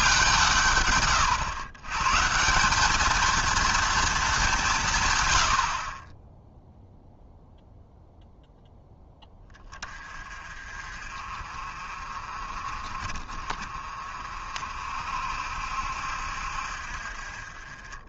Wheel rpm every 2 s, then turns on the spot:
140, 190, 160, 0, 0, 40, 40, 50, 60.
none